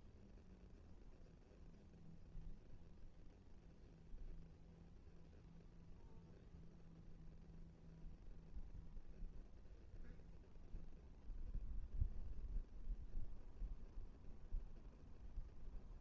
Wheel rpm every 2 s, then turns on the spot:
0, 0, 0, 0, 0, 0, 0, 0.
none